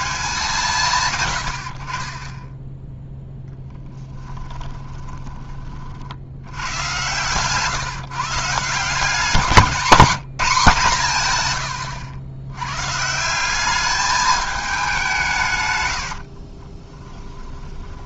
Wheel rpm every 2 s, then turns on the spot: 160, 0, 20, 120, 180, 160, 150, 190, 20.
4-6 16-18